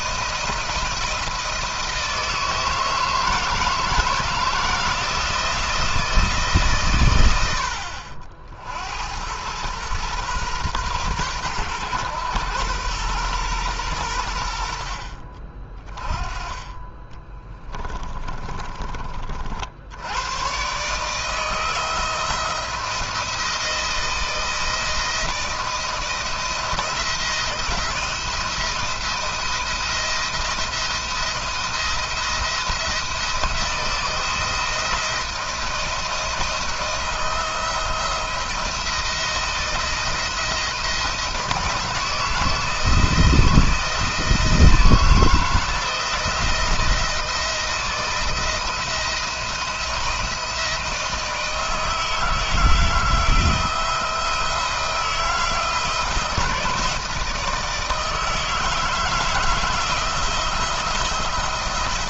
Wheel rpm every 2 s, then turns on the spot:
160, 160, 170, 130, 70, 120, 120, 60, 20, 30, 140, 170, 170, 170, 170, 170, 170, 170, 160, 170, 160, 160, 160, 170, 160, 160, 160, 170, 160, 160, 170.
16-18